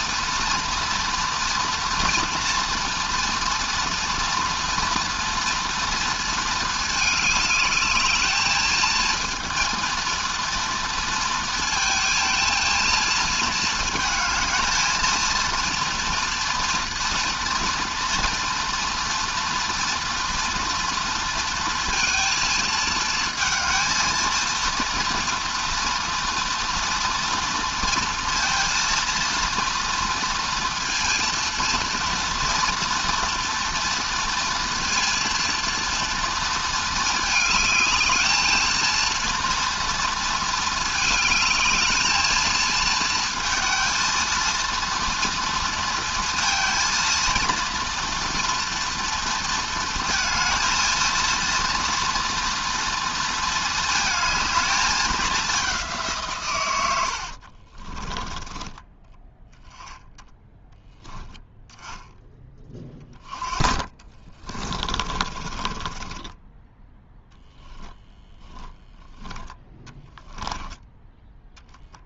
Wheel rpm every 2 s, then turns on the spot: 240, 230, 230, 220, 220, 230, 230, 230, 240, 230, 230, 220, 240, 240, 230, 230, 230, 230, 220, 230, 220, 230, 230, 230, 230, 230, 230, 210, 80, 10, 10, 20, 30, 0, 10, 10.
56-60 62-66